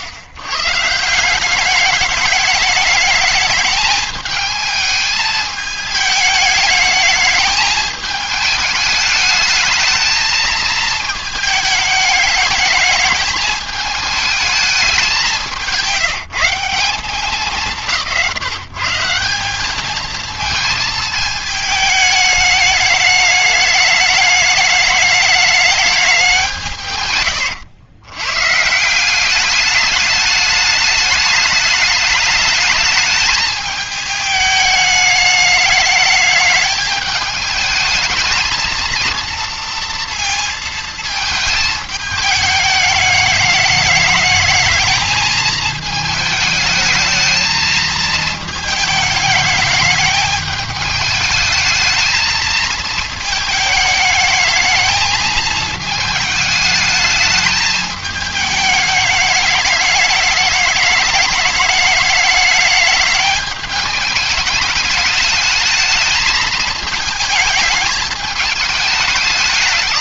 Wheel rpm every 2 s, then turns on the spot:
120, 210, 220, 210, 220, 220, 210, 220, 170, 170, 220, 210, 210, 170, 150, 210, 210, 210, 210, 230, 230, 210, 220, 220, 220, 210, 220, 210, 220, 210, 210, 210, 210, 220, 210.
none